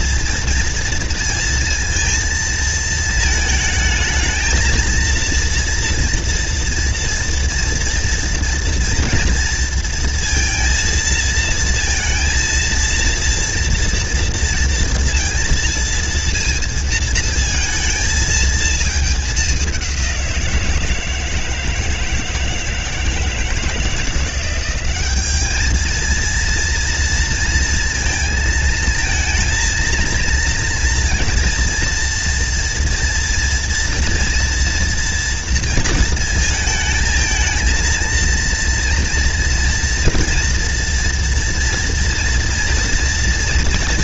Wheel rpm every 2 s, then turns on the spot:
230, 220, 230, 240, 230, 230, 230, 230, 230, 210, 160, 160, 200, 230, 230, 230, 240, 230, 220, 230, 230, 230.
none